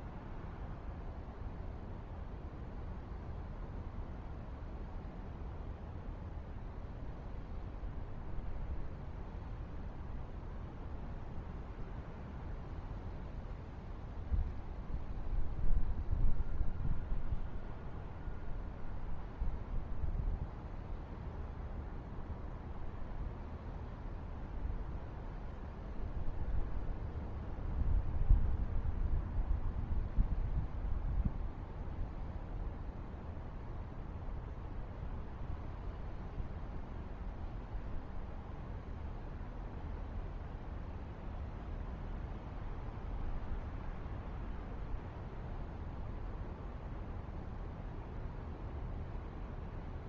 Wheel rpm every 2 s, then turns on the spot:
0, 0, 0, 0, 0, 0, 0, 0, 0, 0, 0, 0, 0, 0, 0, 0, 0, 0, 0, 0, 0, 0, 0, 0, 0.
none